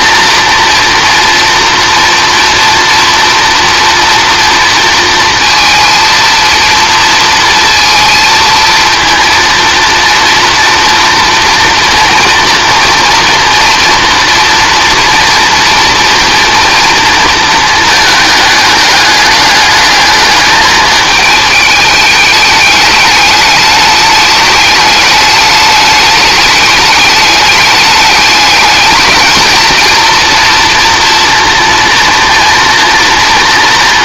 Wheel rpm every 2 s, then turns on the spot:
230, 240, 230, 230, 220, 240, 230, 230, 230, 210, 210, 210, 210, 210, 220, 230, 240.
none